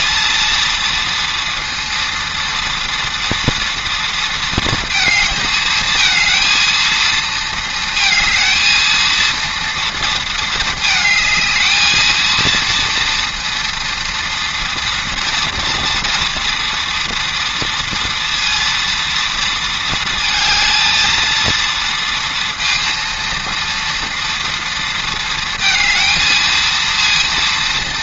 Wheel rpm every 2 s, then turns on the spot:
230, 230, 230, 230, 230, 220, 230, 230, 230, 230, 230, 230, 230, 230.
none